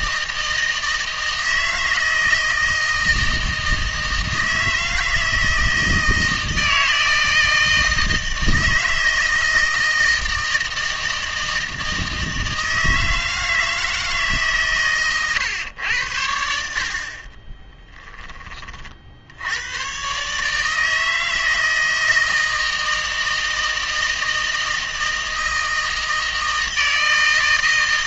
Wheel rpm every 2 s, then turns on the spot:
160, 160, 160, 160, 160, 160, 160, 130, 60, 50, 160, 160, 160, 160.
none